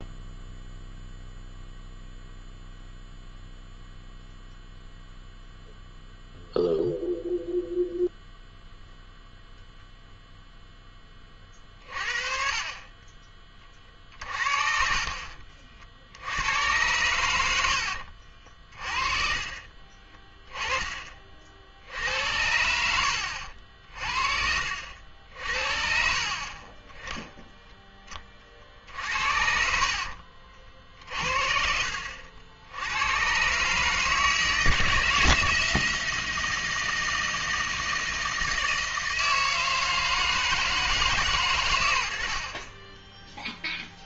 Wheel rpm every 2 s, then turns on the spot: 0, 0, 0, 0, 0, 0, 50, 40, 90, 40, 20, 80, 50, 40, 40, 50, 70, 150, 170, 160, 160, 60.
14-16